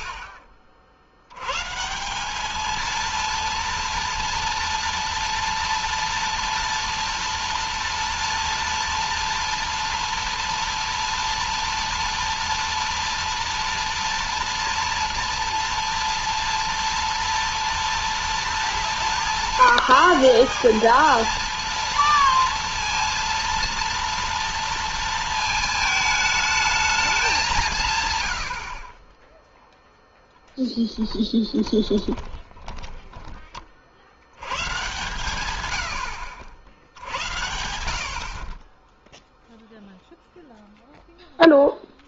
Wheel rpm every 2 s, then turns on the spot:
20, 210, 230, 230, 230, 230, 230, 230, 230, 220, 210, 230, 230, 220, 80, 0, 10, 100, 70, 40, 0.
32-34